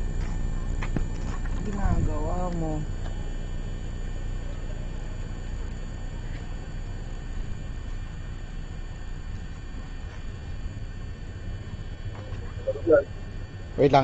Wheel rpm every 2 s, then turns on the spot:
0, 0, 0, 0, 0, 0, 0.
none